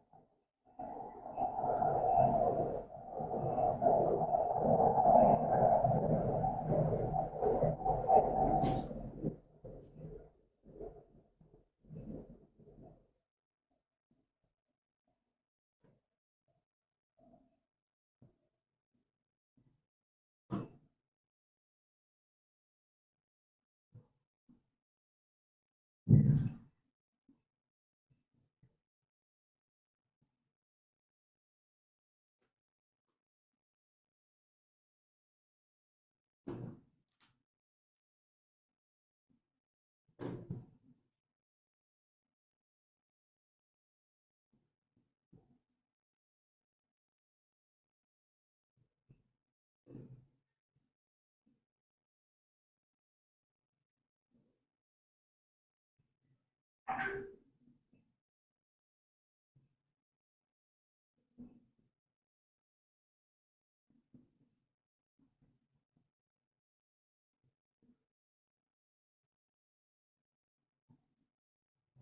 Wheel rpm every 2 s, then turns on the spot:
0, 0, 0, 0, 0, 0, 0, 0, 0, 0, 0, 0, 0, 0, 0, 0, 0, 0, 0, 0, 0, 0, 0, 0, 0, 0, 0, 0, 0, 0, 0, 0, 0, 0, 0, 0.
none